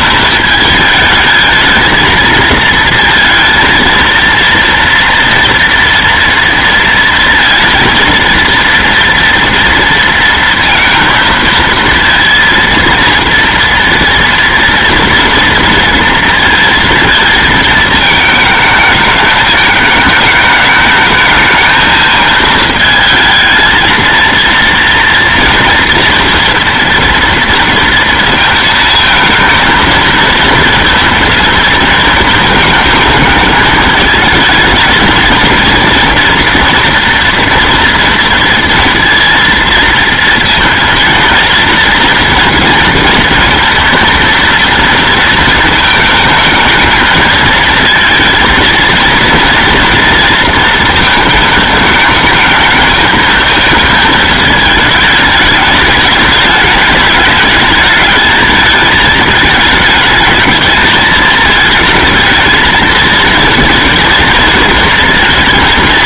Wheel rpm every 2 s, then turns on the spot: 220, 230, 230, 240, 230, 230, 230, 230, 230, 220, 210, 220, 230, 230, 230, 230, 220, 220, 230, 230, 230, 230, 230, 220, 220, 230, 220, 220, 210, 220, 220, 220, 230.
none